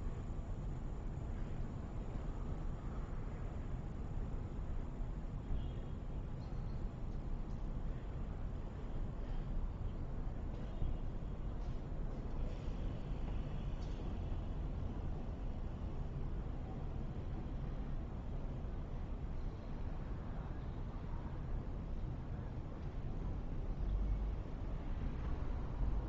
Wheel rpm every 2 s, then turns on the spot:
0, 0, 0, 0, 0, 0, 0, 0, 0, 0, 0, 0, 0.
none